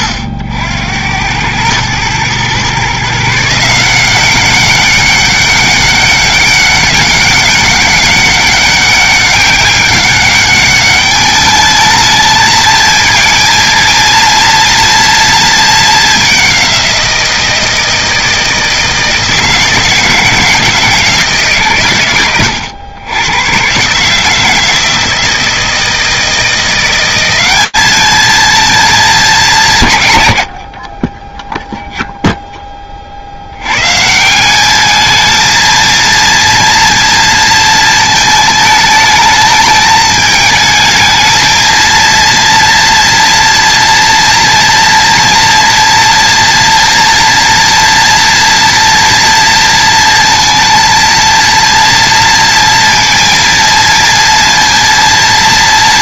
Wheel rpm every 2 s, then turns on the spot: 90, 140, 200, 200, 200, 210, 220, 230, 180, 160, 160, 100, 160, 180, 230, 70, 20, 210, 230, 220, 220, 230, 230, 230, 230, 230, 230, 230.
none